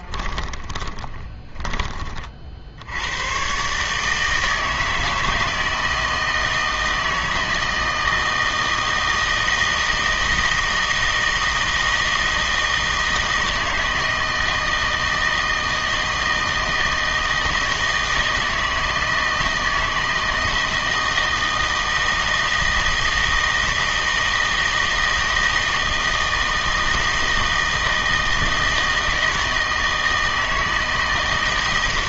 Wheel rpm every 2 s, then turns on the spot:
20, 60, 160, 160, 160, 160, 160, 160, 160, 160, 160, 160, 160, 160, 160, 160.
0-2